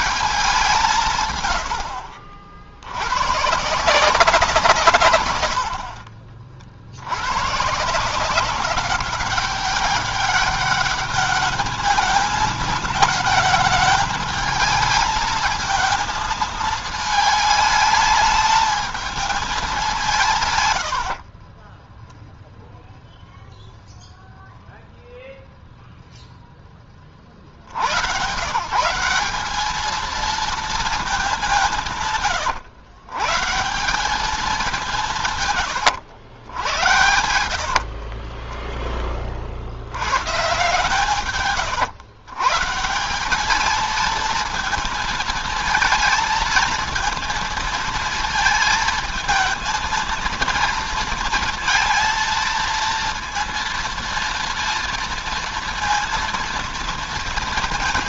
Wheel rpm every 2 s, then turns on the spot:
170, 80, 150, 70, 200, 210, 220, 220, 220, 220, 110, 0, 0, 20, 170, 220, 130, 180, 80, 20, 150, 160, 230, 230, 230, 230, 230, 230, 230.
20-22 36-38